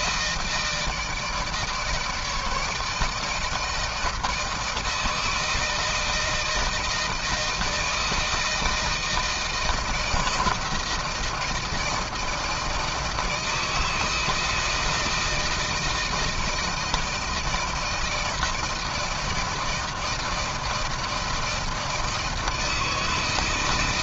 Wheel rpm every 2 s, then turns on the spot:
160, 150, 160, 160, 160, 160, 160, 160, 160, 160, 160, 160.
none